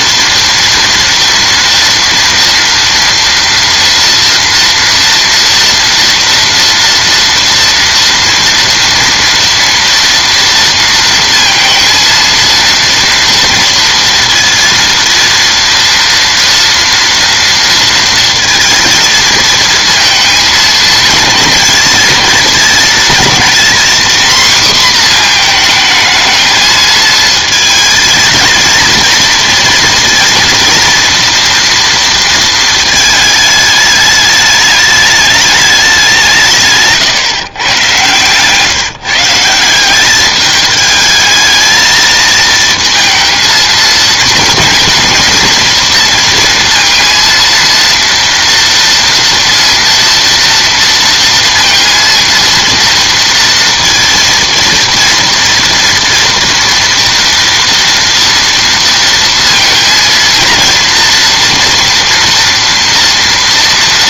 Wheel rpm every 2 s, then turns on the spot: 230, 230, 230, 230, 230, 230, 230, 230, 230, 230, 220, 220, 250, 220, 230, 230, 230, 210, 140, 150, 210, 230, 230, 230, 230, 230, 230, 230, 230, 230, 230, 240.
none